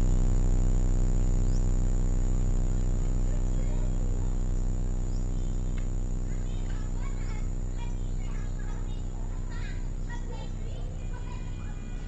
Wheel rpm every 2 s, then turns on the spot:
0, 0, 0, 0, 0, 0.
none